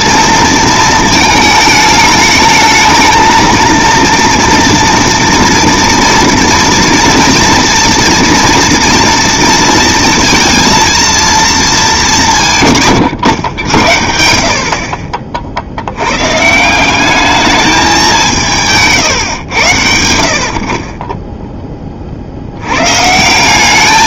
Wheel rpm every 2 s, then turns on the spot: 220, 220, 230, 230, 230, 230, 150, 60, 160, 170, 60, 70.
none